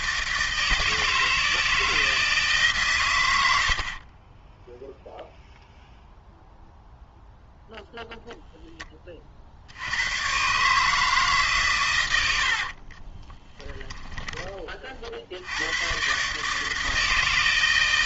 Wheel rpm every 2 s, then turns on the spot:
160, 150, 10, 0, 10, 140, 60, 30, 150.
4-6 12-14